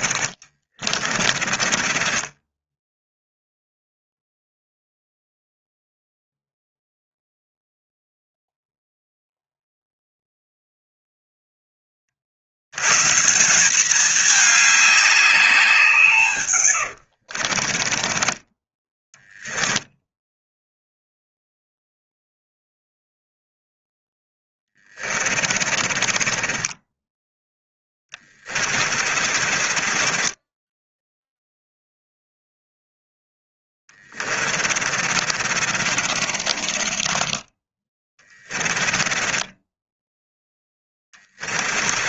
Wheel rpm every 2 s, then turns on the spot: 30, 20, 0, 0, 0, 0, 120, 200, 90, 10, 0, 0, 30, 10, 40, 0, 10, 50, 30, 10, 30.
0-4 16-20 24-26 28-30 32-42